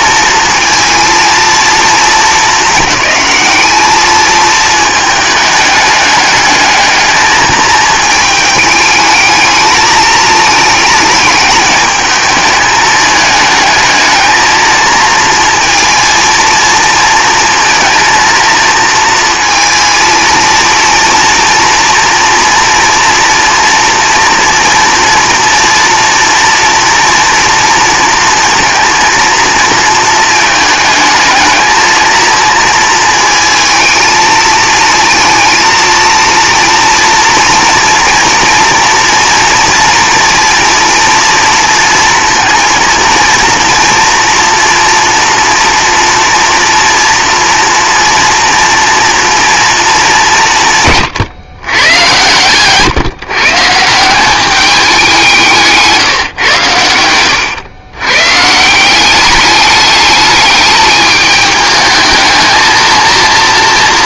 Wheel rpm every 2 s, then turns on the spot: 230, 210, 220, 210, 210, 220, 210, 220, 230, 230, 230, 230, 240, 230, 230, 220, 230, 230, 230, 240, 230, 230, 240, 230, 240, 140, 140, 200, 110, 160, 210, 230.
none